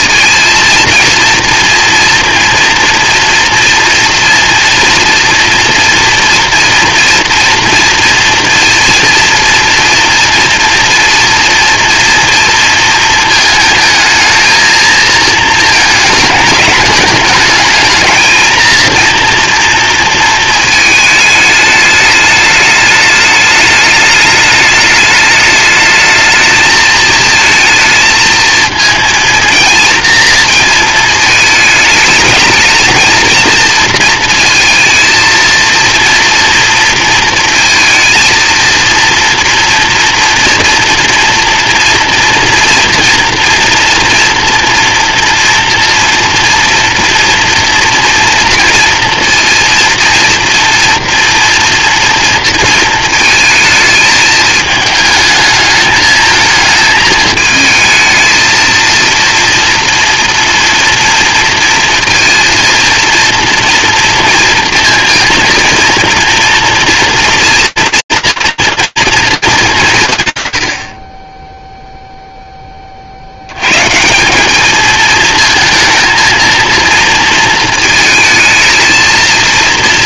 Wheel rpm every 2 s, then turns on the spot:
230, 230, 230, 230, 230, 230, 230, 220, 220, 220, 230, 210, 210, 220, 230, 230, 220, 230, 230, 230, 230, 230, 230, 230, 230, 230, 230, 220, 220, 220, 230, 230, 230, 230, 230, 110, 20, 200, 230, 220.
none